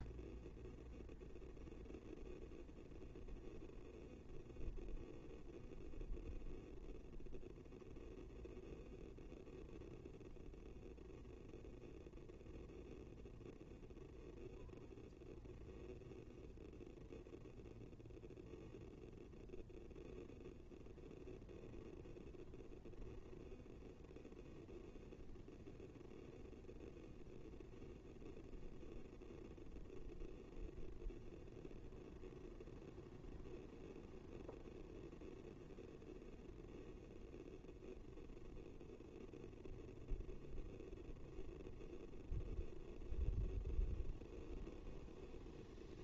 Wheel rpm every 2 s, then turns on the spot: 0, 0, 0, 0, 0, 0, 0, 0, 0, 0, 0, 0, 0, 0, 0, 0, 0, 0, 0, 0, 0, 0, 0.
none